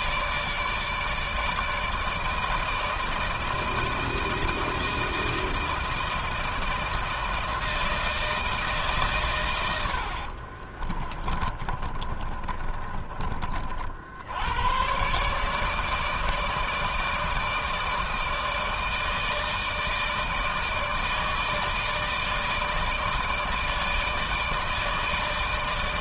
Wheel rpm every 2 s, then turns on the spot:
150, 160, 170, 160, 150, 30, 30, 120, 160, 160, 160, 160, 160.
10-14